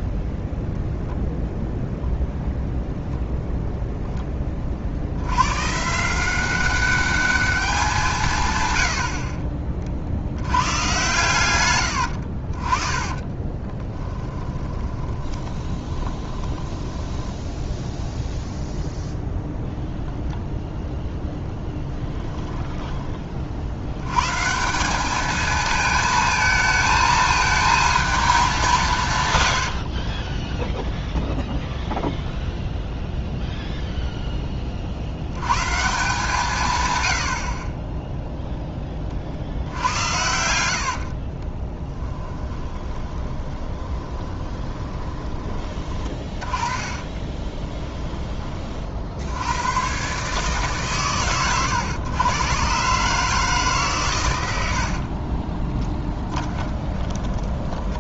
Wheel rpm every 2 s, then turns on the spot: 0, 0, 50, 190, 110, 110, 20, 20, 10, 0, 0, 20, 170, 220, 180, 0, 0, 40, 130, 20, 80, 20, 20, 20, 40, 140, 130, 70, 10.
8-10 12-18 22-24 40-48 54-58